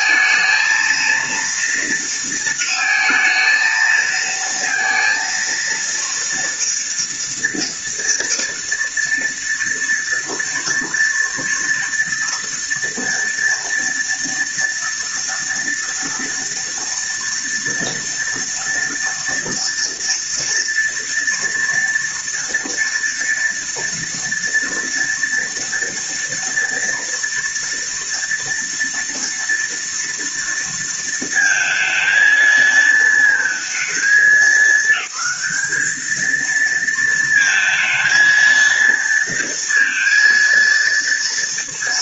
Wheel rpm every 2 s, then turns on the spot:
230, 230, 230, 230, 230, 230, 230, 230, 230, 230, 230, 230, 230, 230, 230, 230, 220, 210, 230, 230, 230.
none